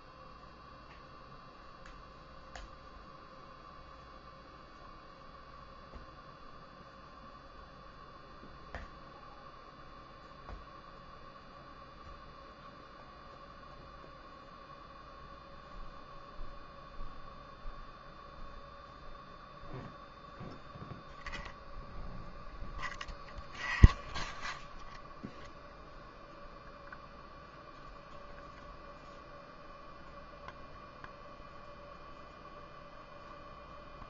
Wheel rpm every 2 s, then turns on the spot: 0, 0, 0, 0, 0, 0, 0, 0, 0, 0, 0, 0, 0, 0, 0, 0, 0.
none